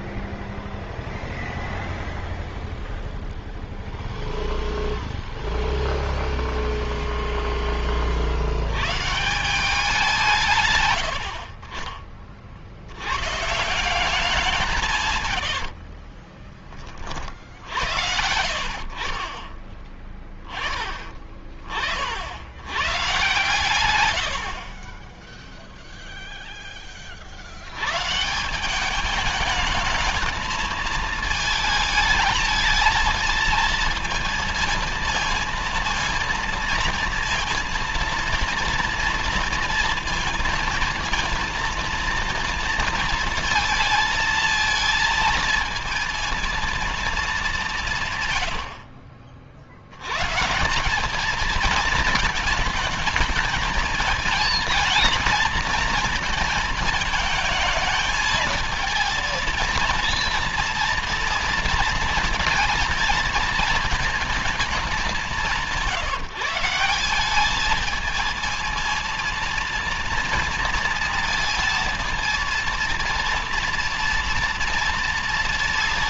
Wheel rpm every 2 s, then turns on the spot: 0, 0, 0, 0, 90, 150, 50, 180, 30, 50, 20, 90, 60, 0, 170, 220, 220, 220, 230, 230, 230, 230, 220, 230, 100, 170, 220, 220, 230, 220, 230, 230, 220, 180, 230, 230, 230, 230.
20-22 48-50